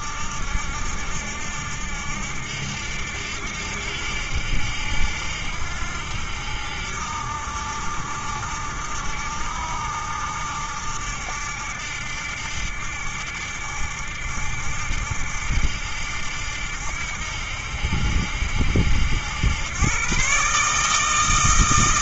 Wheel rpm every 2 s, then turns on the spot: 80, 80, 70, 70, 70, 80, 70, 80, 80, 80, 160.
none